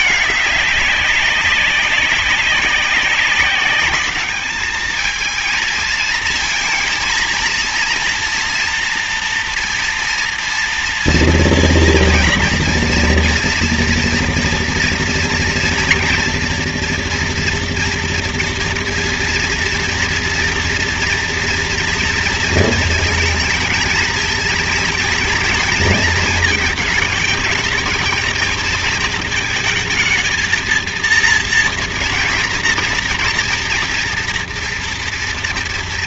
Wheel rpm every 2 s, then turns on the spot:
200, 190, 220, 230, 240, 230, 230, 230, 240, 230, 230, 220, 230, 230, 220, 230, 230, 240.
none